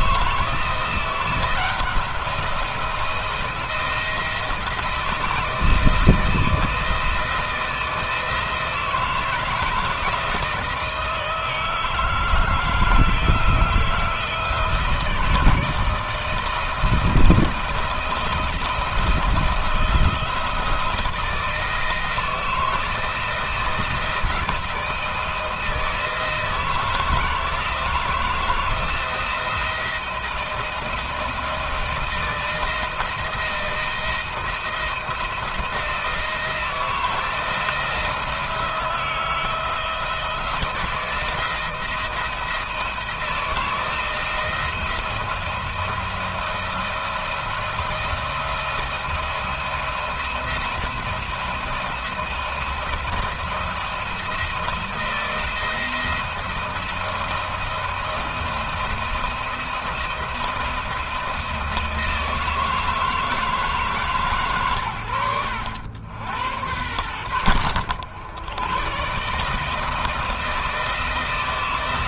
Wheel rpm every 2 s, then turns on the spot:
170, 170, 170, 160, 160, 160, 160, 160, 160, 160, 160, 160, 170, 160, 170, 170, 170, 160, 160, 170, 170, 170, 170, 170, 170, 170, 160, 170, 170, 170, 170, 160, 120, 90, 100, 160.
none